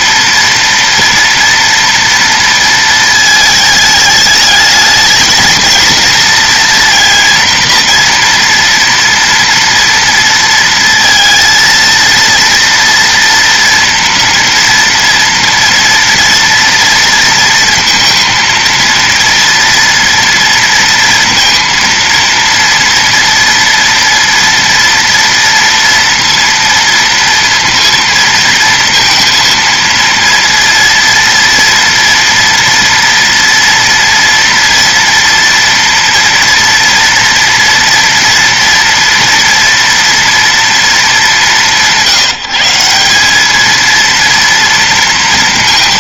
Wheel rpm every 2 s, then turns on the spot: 230, 230, 220, 230, 240, 230, 230, 230, 230, 230, 230, 230, 230, 230, 230, 230, 230, 230, 230, 230, 230, 170, 230.
none